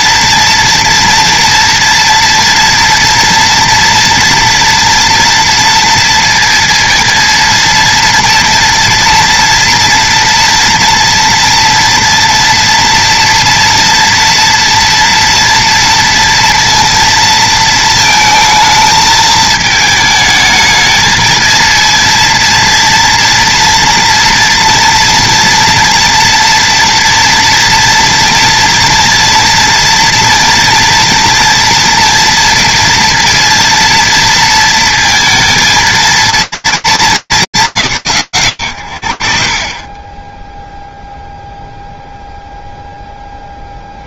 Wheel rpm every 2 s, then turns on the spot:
230, 230, 230, 230, 230, 230, 230, 230, 230, 220, 220, 230, 230, 230, 230, 230, 230, 230, 230, 110, 10, 0.
none